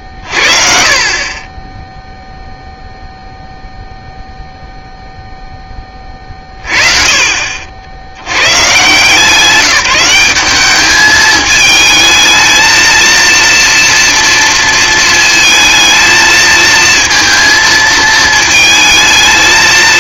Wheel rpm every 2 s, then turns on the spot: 30, 0, 0, 30, 130, 200, 230, 230, 230, 220.
none